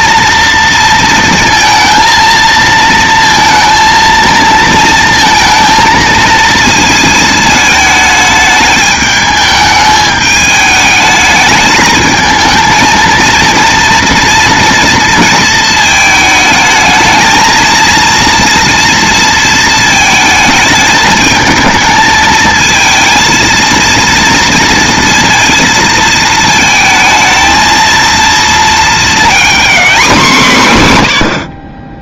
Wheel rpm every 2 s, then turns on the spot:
230, 230, 230, 220, 210, 210, 230, 230, 220, 230, 220, 220, 230, 220, 230, 150.
none